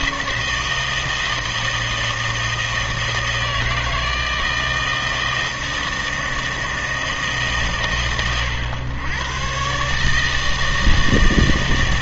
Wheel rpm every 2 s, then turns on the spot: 160, 160, 160, 160, 120, 160.
none